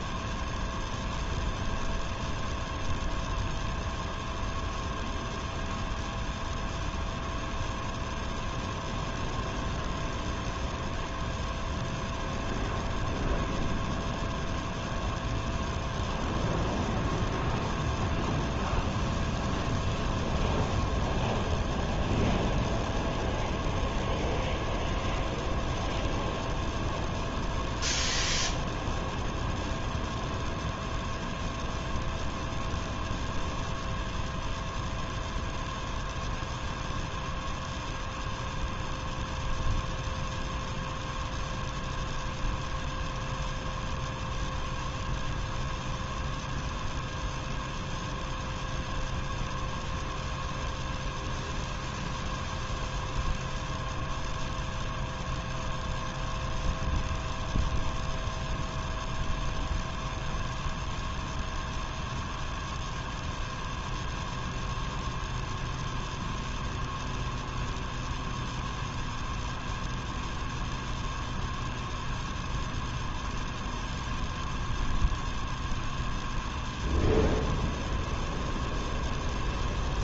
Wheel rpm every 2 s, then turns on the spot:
0, 0, 0, 0, 0, 0, 0, 0, 0, 0, 0, 0, 0, 0, 0, 0, 0, 0, 0, 0, 0, 0, 0, 0, 0, 0, 0, 0, 0, 0, 0, 0, 0, 0, 0, 0, 0, 0, 0, 0.
none